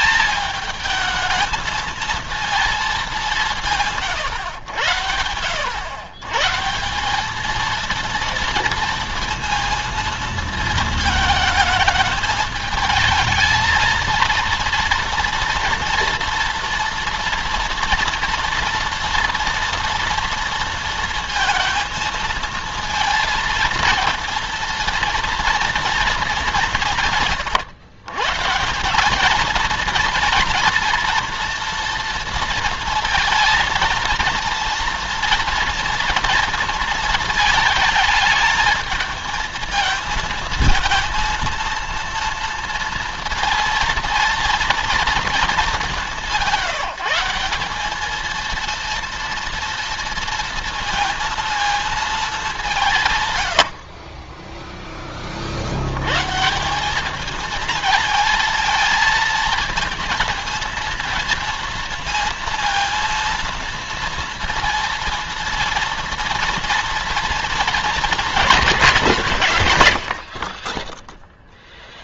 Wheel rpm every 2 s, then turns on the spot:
220, 220, 100, 140, 230, 230, 220, 230, 230, 230, 230, 230, 230, 200, 160, 240, 230, 230, 230, 220, 230, 230, 230, 190, 230, 230, 190, 10, 150, 230, 230, 230, 230, 230, 180, 30.
54-56 70-72